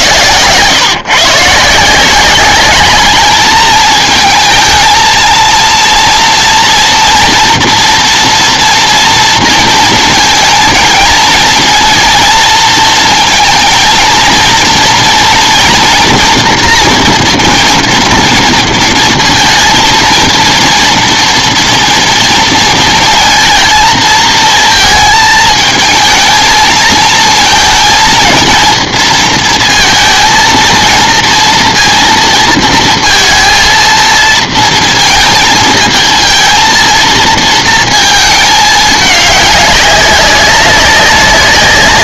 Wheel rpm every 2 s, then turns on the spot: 130, 200, 220, 230, 230, 230, 230, 230, 230, 230, 230, 230, 220, 220, 230, 230, 230, 220, 230, 220, 200.
none